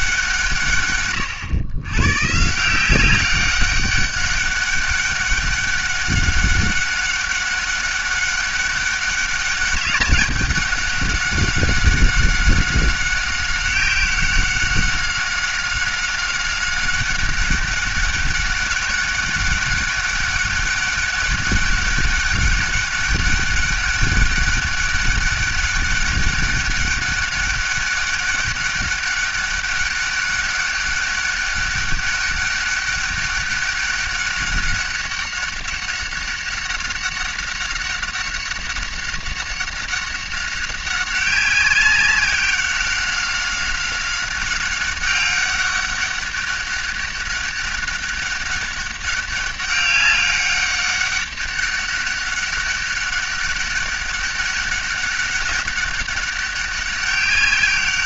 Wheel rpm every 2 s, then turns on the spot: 110, 200, 200, 200, 200, 190, 190, 190, 200, 200, 200, 200, 200, 200, 200, 200, 200, 200, 190, 190, 190, 190, 200, 200, 200, 200, 200, 200, 200.
none